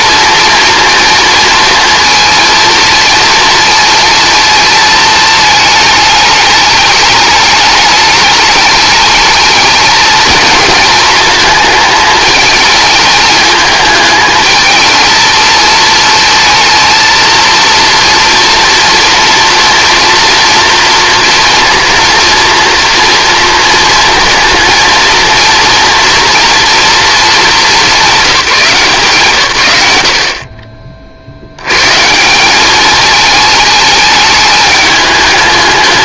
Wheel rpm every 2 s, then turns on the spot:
230, 230, 230, 220, 210, 230, 220, 220, 220, 230, 230, 230, 230, 230, 170, 40, 200, 210.
none